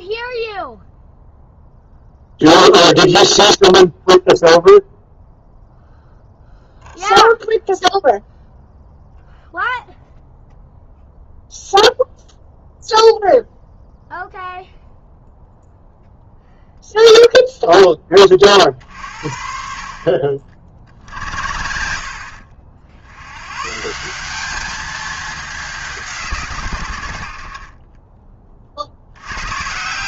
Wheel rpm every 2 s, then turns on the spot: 0, 0, 0, 0, 0, 0, 0, 0, 0, 50, 60, 70, 210, 100, 60.
none